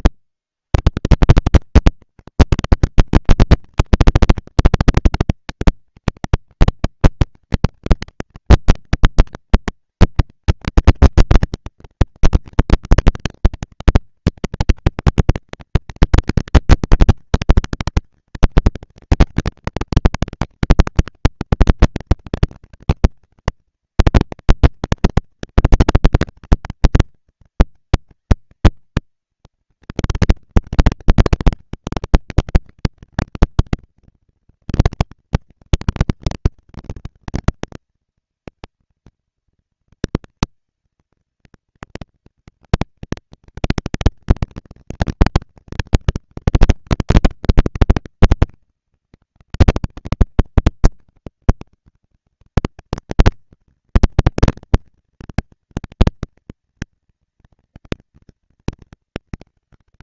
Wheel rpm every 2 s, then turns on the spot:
130, 200, 220, 200, 220, 220, 220, 220, 230, 230, 240, 230, 230, 220, 240, 230, 220, 240, 230, 230, 230, 230, 220, 220, 200, 200, 210, 230, 230, 230.
none